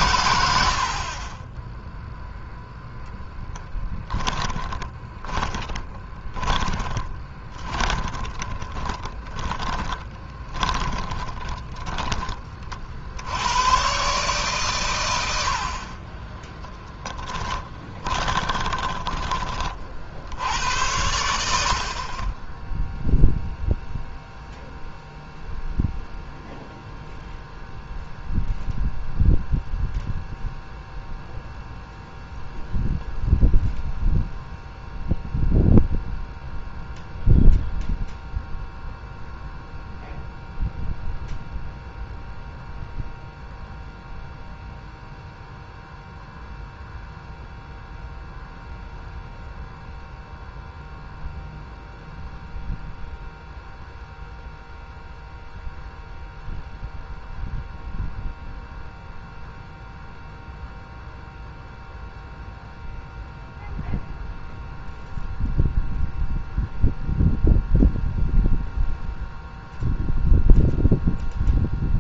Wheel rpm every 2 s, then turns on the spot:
60, 0, 20, 20, 20, 20, 50, 110, 10, 20, 80, 0, 0, 0, 0, 0, 0, 0, 0, 0, 0, 0, 0, 0, 0, 0, 0, 0, 0, 0, 0, 0, 0, 0, 0, 0.
4-12 16-20